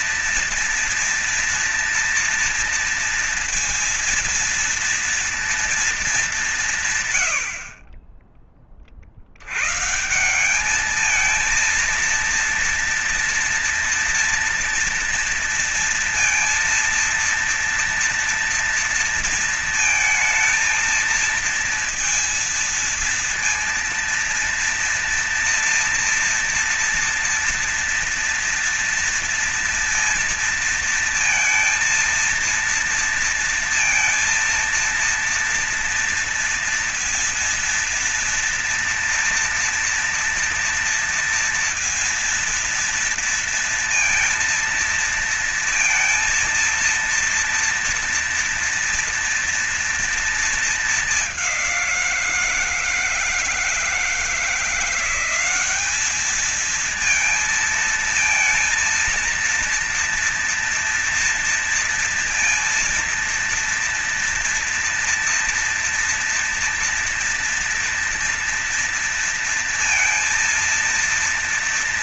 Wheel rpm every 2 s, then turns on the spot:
230, 230, 230, 160, 40, 200, 230, 230, 230, 230, 230, 230, 230, 240, 230, 230, 230, 230, 230, 230, 240, 230, 230, 230, 230, 220, 170, 180, 220, 230, 230, 230, 230, 230, 230, 230.
none